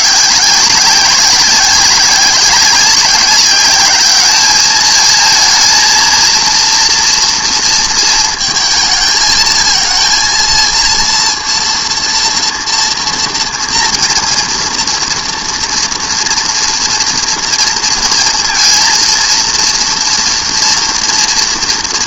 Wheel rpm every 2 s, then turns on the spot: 190, 190, 220, 230, 220, 230, 230, 230, 230, 230, 240.
none